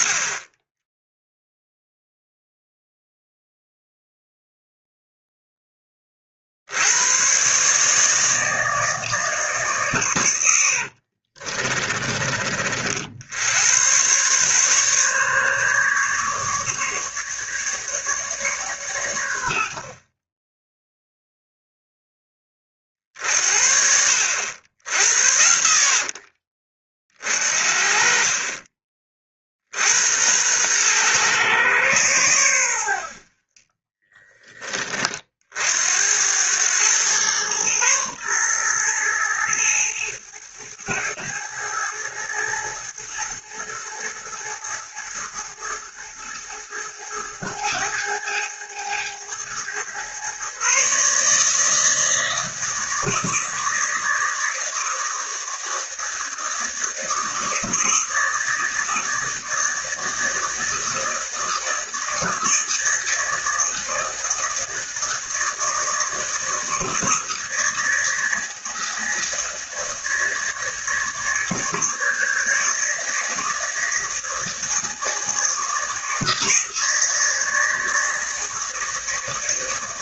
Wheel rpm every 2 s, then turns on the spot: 20, 0, 0, 90, 160, 70, 50, 140, 150, 120, 0, 40, 80, 40, 40, 110, 80, 20, 110, 120, 110, 110, 110, 110, 110, 140, 160, 160, 170, 160, 160, 160, 160, 160, 160, 150, 150, 160, 160, 160.
10-12